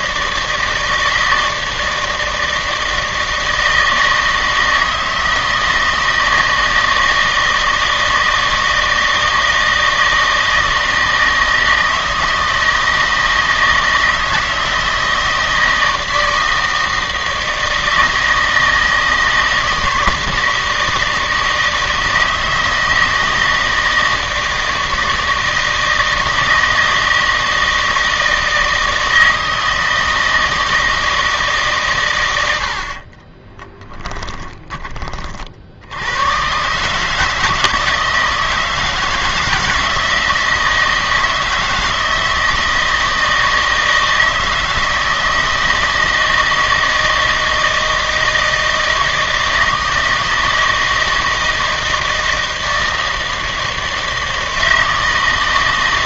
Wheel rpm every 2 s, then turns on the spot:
160, 160, 160, 160, 160, 160, 160, 160, 160, 160, 160, 160, 160, 160, 160, 160, 70, 10, 140, 160, 160, 160, 160, 160, 160, 160, 160, 160.
none